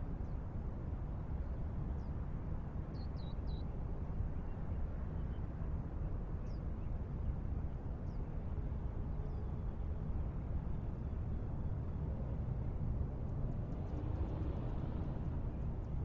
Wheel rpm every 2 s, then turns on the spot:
0, 0, 0, 0, 0, 0, 0, 0.
none